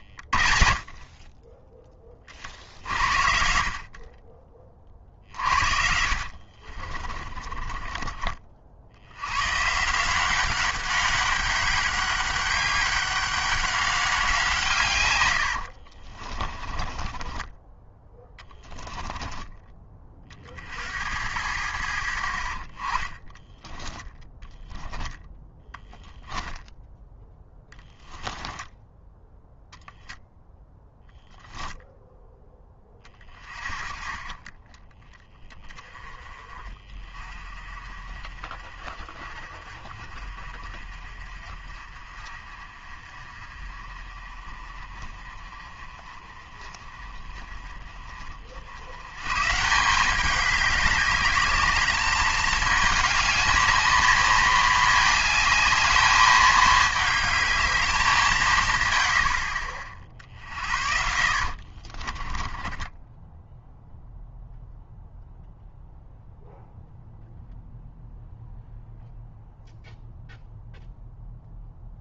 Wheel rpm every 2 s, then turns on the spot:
30, 60, 40, 40, 70, 200, 190, 140, 20, 10, 70, 30, 10, 10, 10, 10, 10, 10, 30, 40, 40, 40, 30, 30, 80, 200, 220, 220, 220, 110, 60, 10, 0, 0, 0, 0.
6-8 16-20 28-30 32-34 60-64